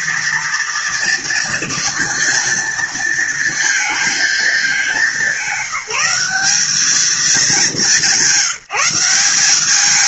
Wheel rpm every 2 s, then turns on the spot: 230, 230, 200, 210, 180.
none